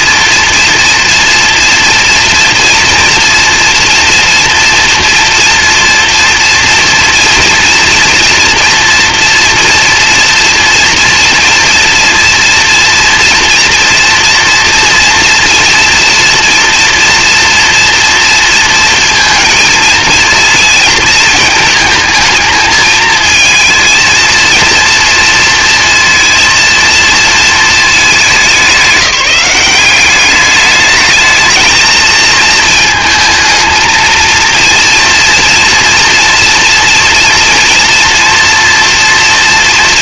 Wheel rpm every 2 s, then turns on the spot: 230, 230, 230, 230, 240, 240, 230, 230, 240, 230, 230, 220, 230, 230, 190, 210, 230, 230, 230, 230.
none